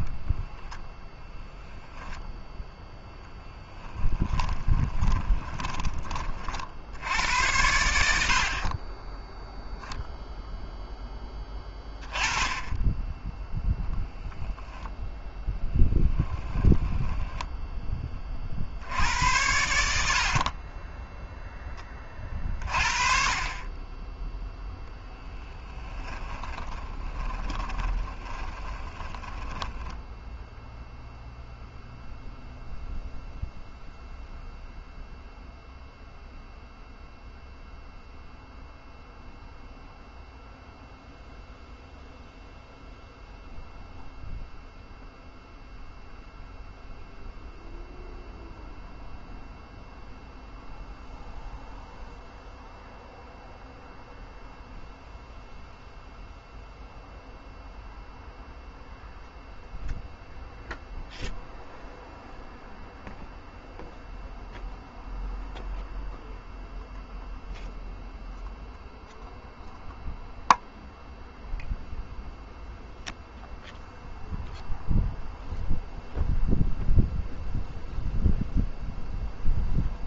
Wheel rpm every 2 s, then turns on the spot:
40, 0, 10, 30, 70, 0, 30, 10, 10, 20, 70, 20, 20, 10, 20, 10, 0, 0, 0, 0, 0, 0, 0, 0, 0, 0, 0, 0, 0, 0, 0, 0, 0, 0, 0, 0, 0, 0, 0, 0.
0-2 4-6 16-18 24-30